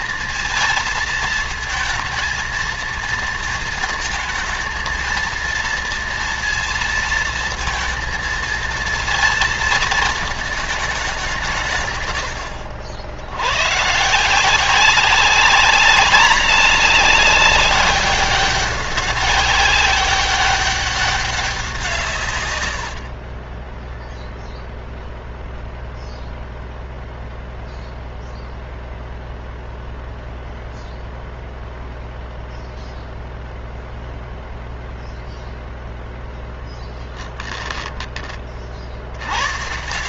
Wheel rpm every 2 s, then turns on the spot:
220, 220, 220, 230, 230, 220, 70, 190, 200, 200, 200, 90, 0, 0, 0, 0, 0, 0, 10, 60.
22-24 36-38